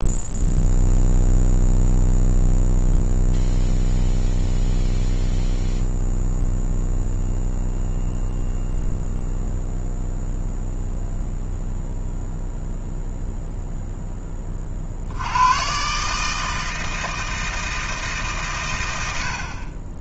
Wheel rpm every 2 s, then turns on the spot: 0, 0, 0, 0, 0, 0, 0, 50, 160, 100.
none